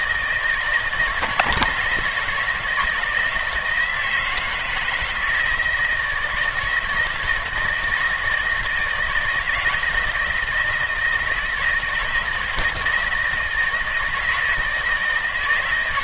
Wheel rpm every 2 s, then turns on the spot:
160, 170, 160, 160, 160, 160, 160, 160.
none